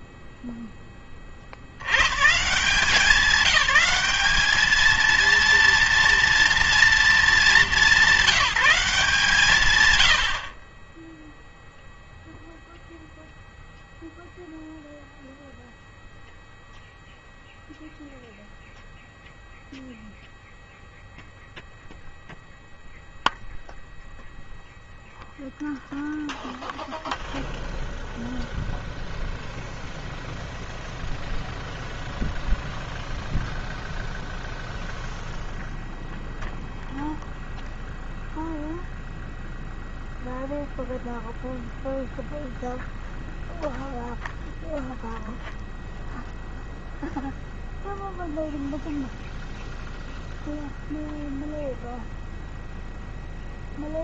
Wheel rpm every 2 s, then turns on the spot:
100, 200, 230, 210, 140, 0, 0, 0, 0, 0, 0, 0, 0, 0, 0, 0, 0, 0, 0, 0, 0, 0, 0, 0, 0, 0, 0.
none